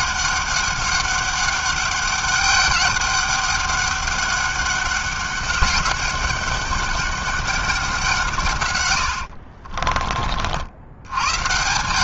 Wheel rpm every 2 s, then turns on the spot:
200, 200, 200, 200, 140, 50.
none